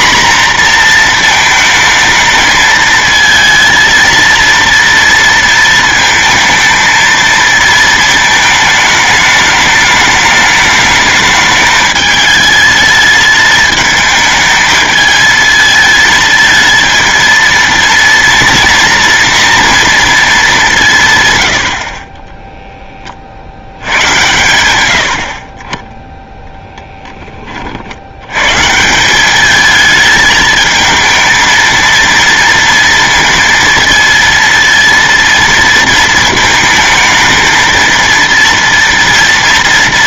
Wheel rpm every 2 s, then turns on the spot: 240, 220, 230, 230, 220, 210, 220, 220, 230, 230, 200, 10, 90, 0, 150, 220, 230, 230, 220, 230.
none